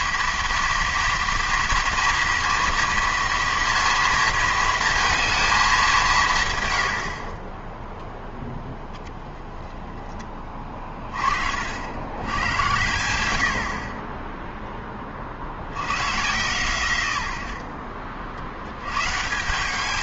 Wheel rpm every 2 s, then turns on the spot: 230, 230, 230, 110, 0, 20, 90, 10, 120, 80.
none